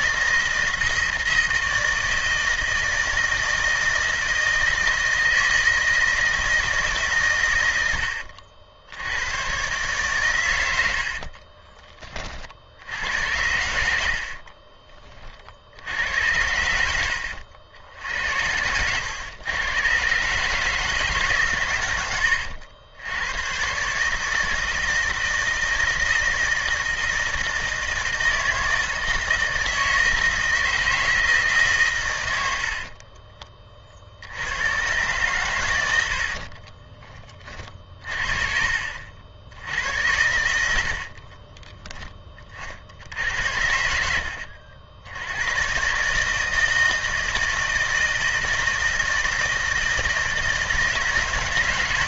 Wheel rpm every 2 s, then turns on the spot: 160, 160, 160, 160, 80, 100, 60, 40, 90, 80, 150, 80, 160, 160, 160, 160, 60, 90, 50, 50, 80, 60, 70, 160, 160, 160.
14-20 32-34 36-38 40-42